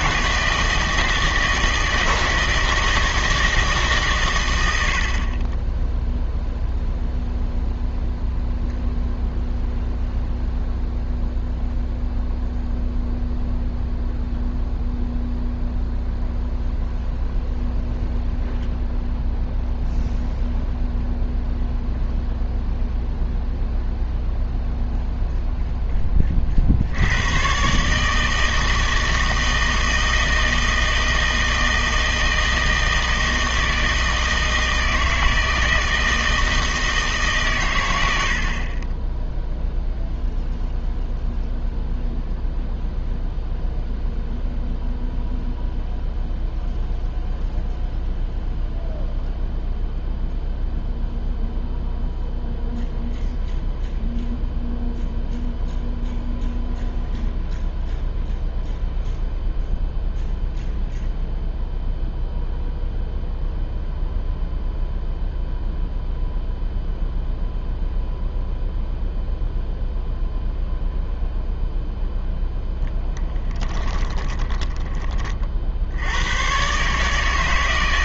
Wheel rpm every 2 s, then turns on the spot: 160, 160, 80, 0, 0, 0, 0, 0, 0, 0, 0, 0, 0, 70, 160, 160, 160, 160, 160, 30, 0, 0, 0, 0, 0, 0, 0, 0, 0, 0, 0, 0, 0, 0, 0, 0, 0, 20, 130.
none